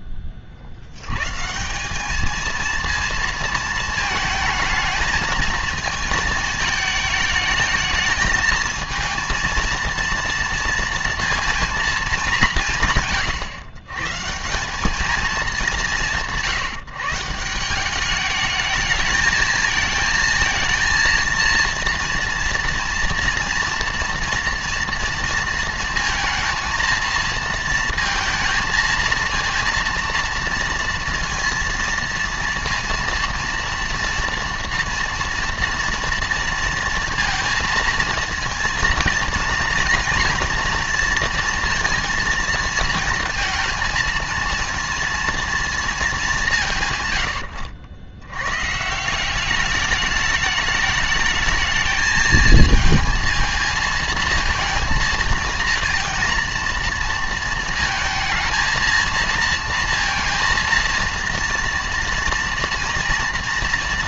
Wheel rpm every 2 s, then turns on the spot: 40, 220, 220, 220, 220, 230, 180, 190, 160, 210, 230, 240, 230, 220, 230, 230, 230, 230, 230, 230, 240, 230, 230, 170, 130, 210, 220, 230, 230, 230, 230, 230.
none